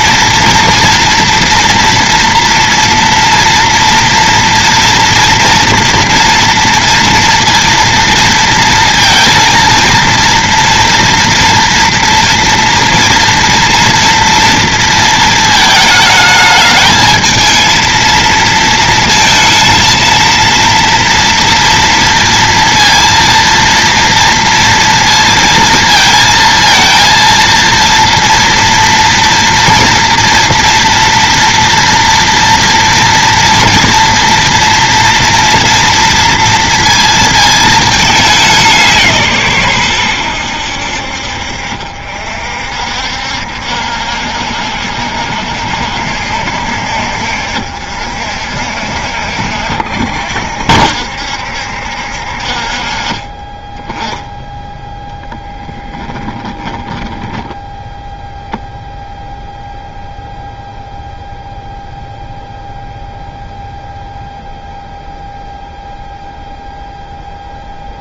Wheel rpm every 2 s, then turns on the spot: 230, 230, 230, 230, 230, 230, 230, 230, 220, 230, 230, 230, 230, 230, 230, 230, 230, 230, 230, 170, 70, 60, 60, 60, 60, 70, 40, 10, 10, 0, 0, 0, 0, 0.
56-58